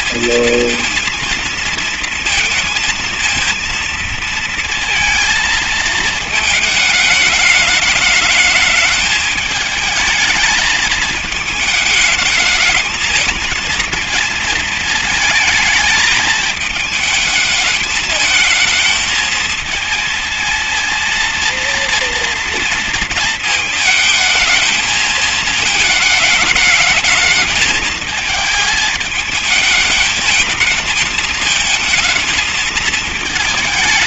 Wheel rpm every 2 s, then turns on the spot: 230, 230, 230, 210, 220, 220, 220, 220, 220, 220, 230, 230, 220, 220, 220, 220, 220.
none